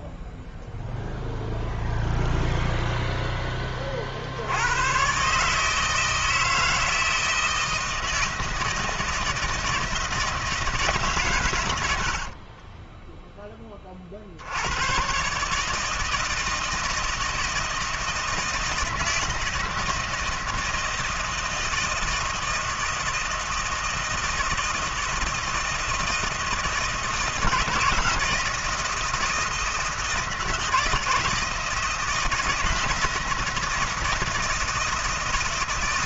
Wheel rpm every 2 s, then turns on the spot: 0, 0, 70, 160, 160, 160, 50, 70, 160, 160, 160, 160, 160, 160, 160, 160, 170, 160.
12-14